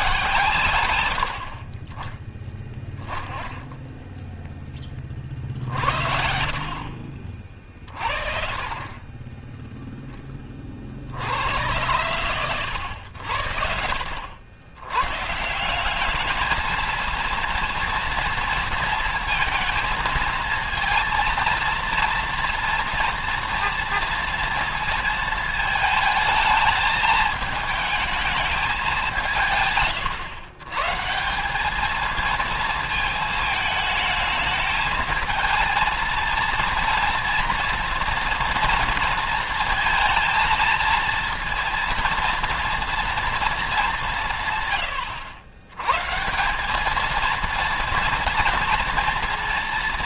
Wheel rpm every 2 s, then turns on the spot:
110, 10, 30, 60, 30, 40, 100, 110, 220, 230, 230, 230, 230, 220, 190, 130, 220, 230, 230, 230, 230, 230, 110, 200, 230.
0-2